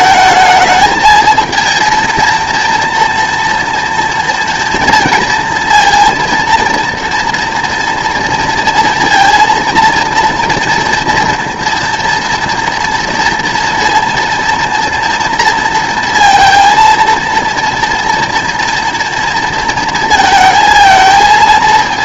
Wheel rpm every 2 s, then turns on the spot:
220, 230, 230, 230, 230, 230, 230, 230, 230, 230, 220.
none